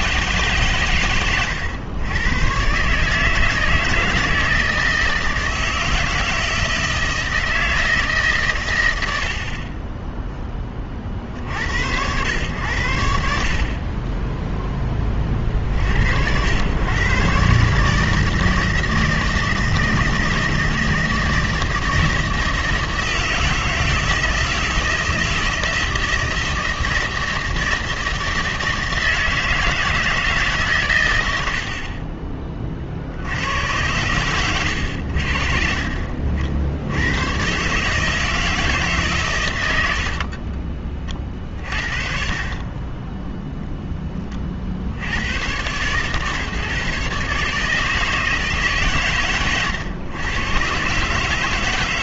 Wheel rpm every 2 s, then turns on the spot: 140, 120, 160, 160, 120, 20, 100, 0, 100, 160, 160, 160, 160, 160, 160, 140, 30, 100, 70, 160, 30, 40, 40, 140, 150, 120.
40-42